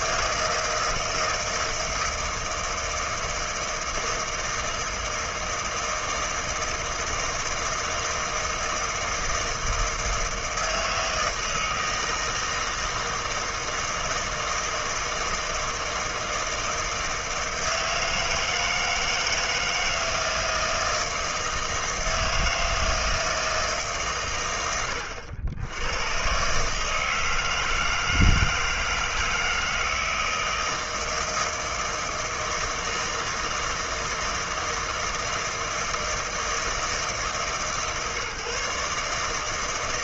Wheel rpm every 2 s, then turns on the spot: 160, 160, 160, 160, 160, 160, 160, 160, 160, 160, 160, 160, 100, 140, 160, 160, 160, 160, 160, 140.
none